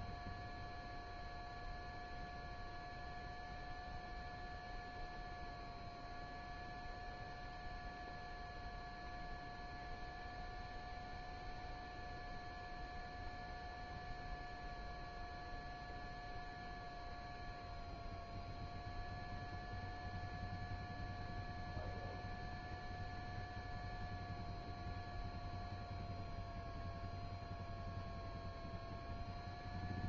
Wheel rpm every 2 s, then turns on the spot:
0, 0, 0, 0, 0, 0, 0, 0, 0, 0, 0, 0, 0, 0, 0.
none